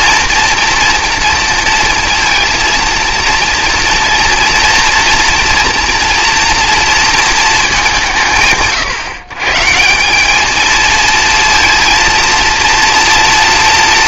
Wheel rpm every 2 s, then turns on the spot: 230, 230, 230, 230, 100, 220, 230.
none